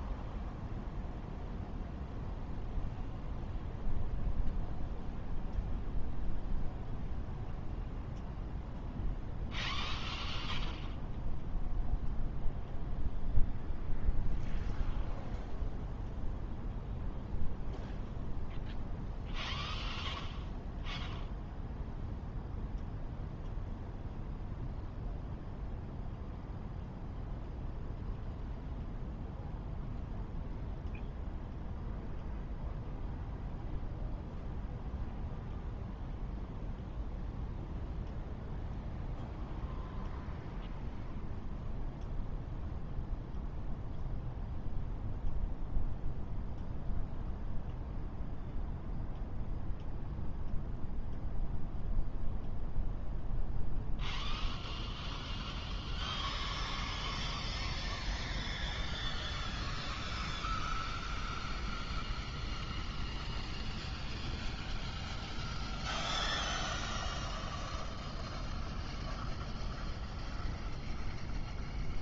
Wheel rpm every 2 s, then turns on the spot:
0, 0, 0, 0, 0, 0, 0, 0, 0, 0, 0, 0, 0, 0, 0, 0, 0, 0, 0, 0, 0, 0, 0, 0, 0, 0, 0, 0, 0, 0, 0, 0, 0, 0, 0, 0.
none